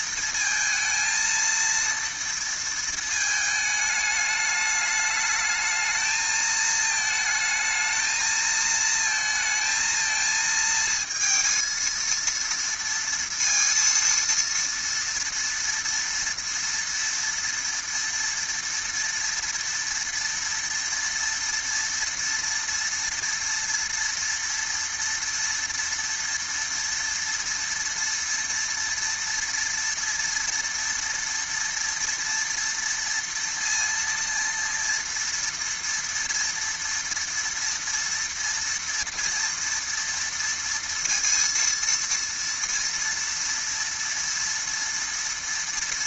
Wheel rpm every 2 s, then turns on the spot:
230, 230, 210, 220, 220, 220, 230, 230, 230, 230, 230, 230, 230, 230, 230, 230, 230, 230, 230, 230, 230, 230, 230.
none